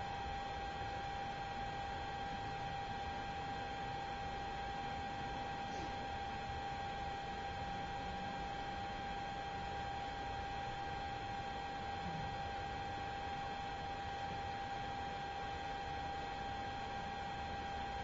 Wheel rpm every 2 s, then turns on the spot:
0, 0, 0, 0, 0, 0, 0, 0, 0.
none